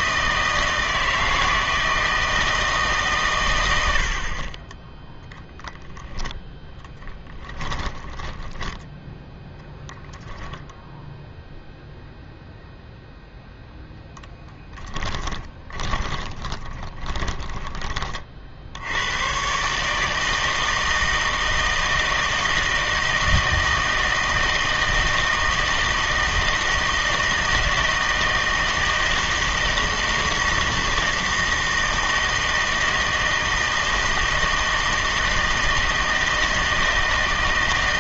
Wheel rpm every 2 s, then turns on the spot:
160, 160, 20, 0, 10, 0, 0, 10, 20, 70, 160, 160, 160, 160, 160, 160, 160, 160, 160.
8-10 14-18